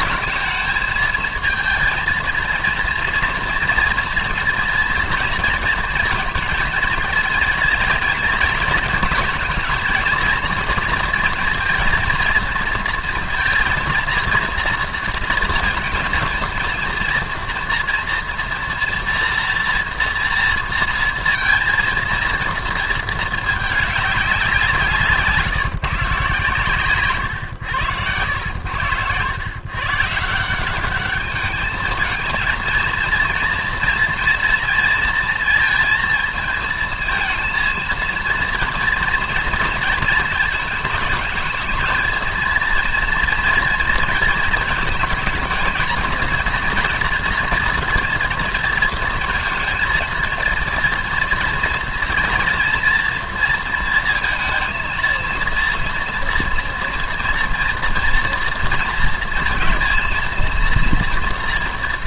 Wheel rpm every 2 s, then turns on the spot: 220, 230, 230, 230, 230, 230, 230, 220, 230, 240, 230, 230, 180, 130, 90, 170, 230, 230, 220, 230, 220, 230, 230, 230, 230, 230, 230, 230, 230, 230, 230.
none